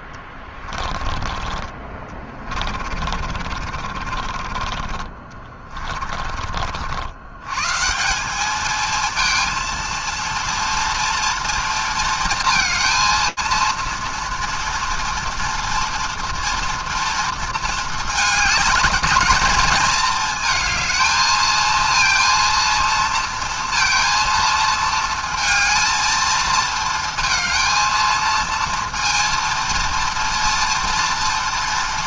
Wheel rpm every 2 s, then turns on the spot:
30, 40, 40, 50, 210, 230, 230, 230, 230, 210, 220, 230, 230, 220, 230, 230.
0-6